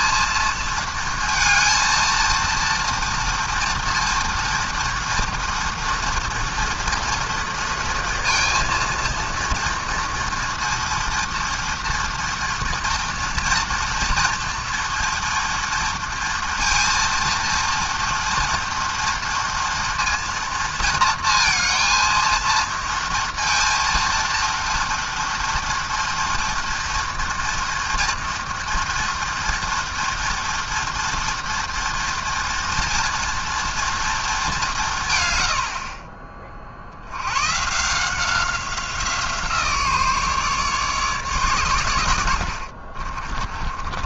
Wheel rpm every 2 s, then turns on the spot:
230, 230, 230, 230, 230, 230, 230, 230, 230, 230, 230, 230, 230, 240, 230, 230, 230, 170, 50, 180, 140, 50.
42-44